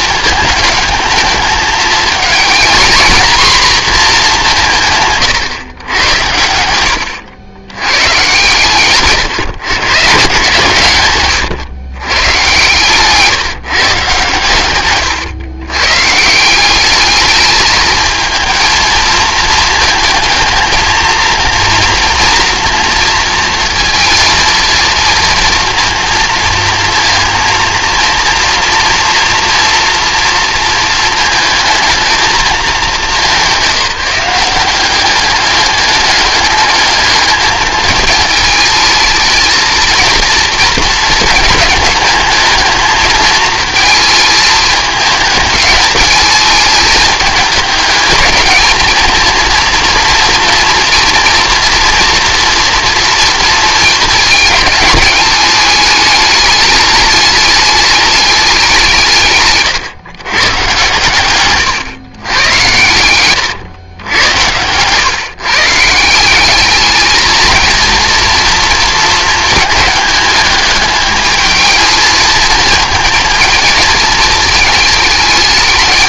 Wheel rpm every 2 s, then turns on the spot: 220, 230, 170, 90, 130, 130, 150, 120, 210, 220, 220, 230, 230, 230, 230, 220, 210, 190, 210, 220, 220, 220, 210, 210, 220, 230, 230, 210, 210, 180, 120, 120, 110, 210, 230, 210, 220, 210.
none